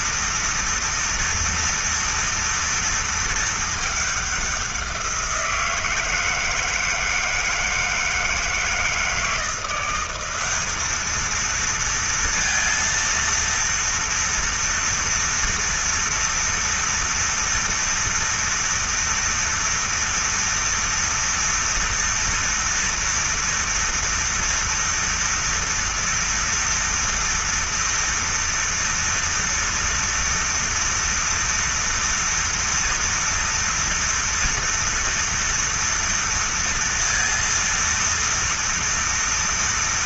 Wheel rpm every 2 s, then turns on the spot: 230, 230, 180, 160, 160, 210, 230, 230, 230, 230, 230, 230, 230, 230, 230, 230, 230, 230, 230, 230.
none